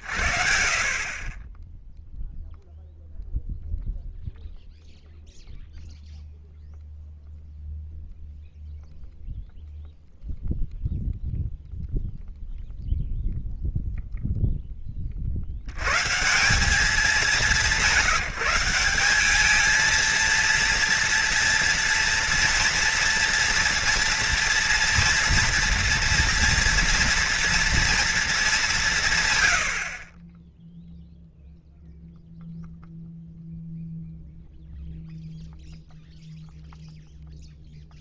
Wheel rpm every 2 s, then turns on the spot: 80, 0, 0, 0, 0, 0, 0, 0, 120, 180, 220, 230, 230, 230, 230, 50, 0, 0, 0.
none